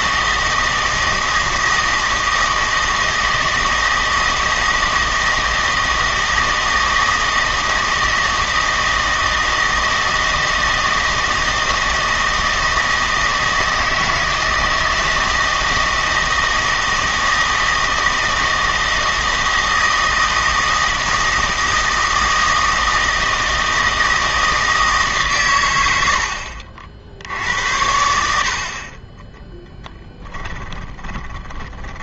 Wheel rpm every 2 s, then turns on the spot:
160, 160, 160, 160, 160, 160, 160, 160, 160, 160, 160, 160, 160, 60, 60, 10.
30-32